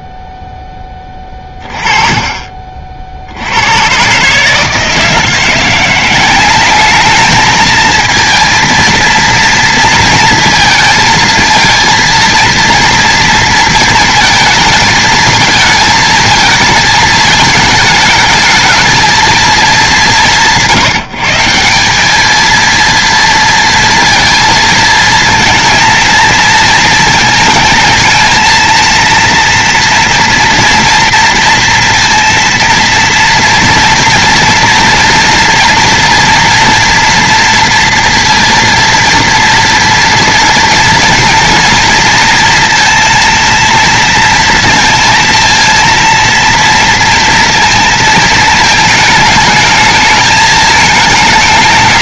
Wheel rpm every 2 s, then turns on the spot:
0, 30, 140, 180, 230, 230, 230, 220, 220, 210, 160, 210, 230, 230, 230, 230, 230, 230, 230, 230, 230, 230, 230, 230, 220, 220.
none